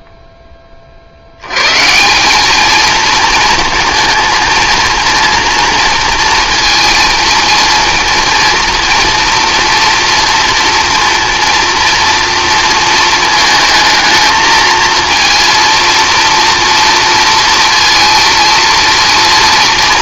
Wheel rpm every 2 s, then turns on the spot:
0, 190, 230, 230, 230, 230, 230, 220, 230, 230.
none